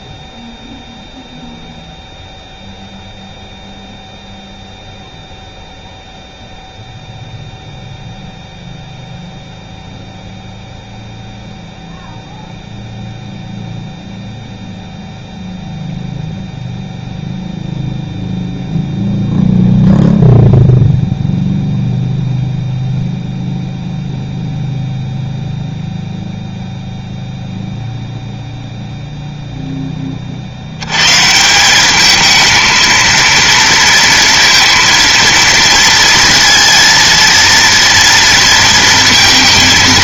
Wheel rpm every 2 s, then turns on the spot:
0, 0, 0, 0, 0, 0, 0, 0, 0, 0, 0, 0, 0, 0, 0, 80, 230, 230, 230, 230.
none